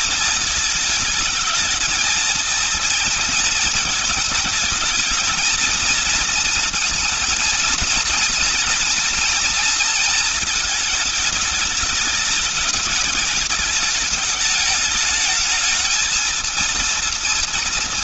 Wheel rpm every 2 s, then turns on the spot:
210, 230, 220, 230, 230, 220, 210, 210, 230.
none